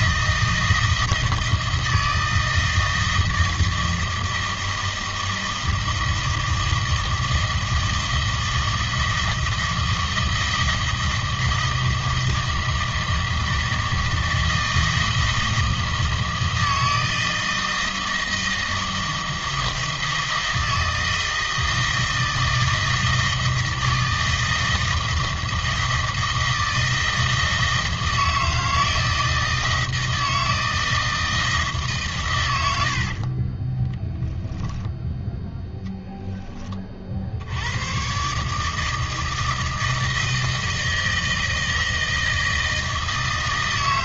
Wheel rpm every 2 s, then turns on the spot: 160, 160, 160, 160, 160, 160, 160, 160, 160, 160, 160, 160, 160, 160, 160, 160, 90, 0, 20, 150, 160, 160.
none